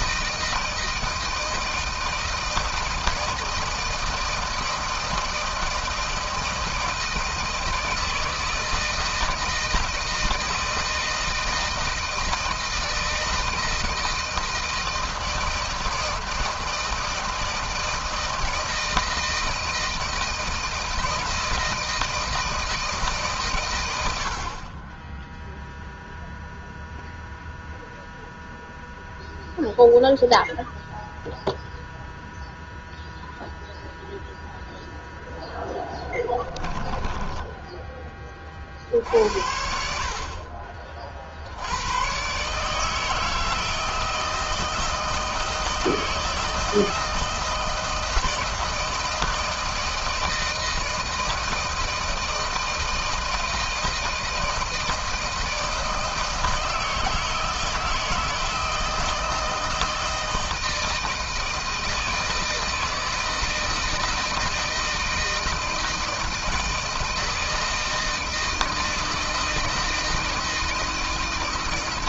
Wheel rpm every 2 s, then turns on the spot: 160, 160, 160, 160, 160, 160, 160, 160, 160, 160, 160, 160, 70, 0, 0, 0, 0, 0, 10, 30, 50, 120, 160, 160, 160, 160, 160, 160, 160, 160, 160, 160, 160, 160, 160, 160.
36-38